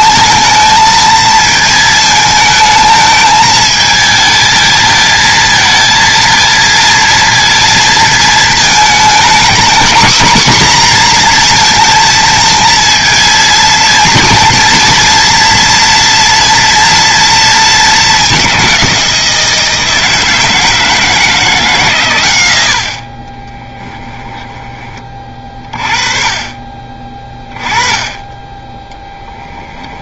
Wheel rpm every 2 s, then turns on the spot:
220, 220, 220, 230, 230, 240, 230, 230, 230, 190, 160, 80, 20, 30, 10.
none